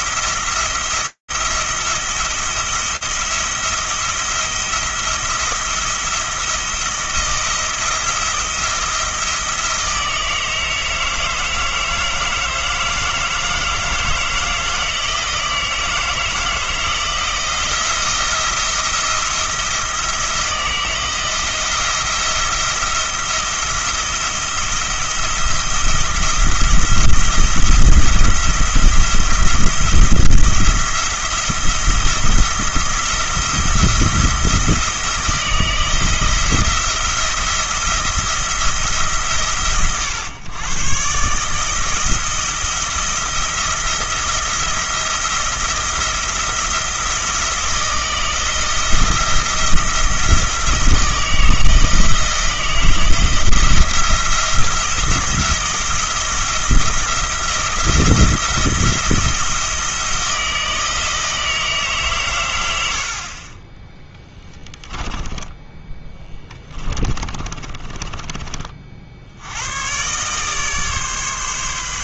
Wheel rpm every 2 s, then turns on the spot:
170, 170, 170, 170, 170, 160, 160, 160, 160, 170, 170, 170, 170, 170, 170, 170, 170, 170, 170, 160, 120, 170, 170, 170, 170, 170, 170, 170, 160, 170, 160, 90, 10, 20, 40, 140.
64-68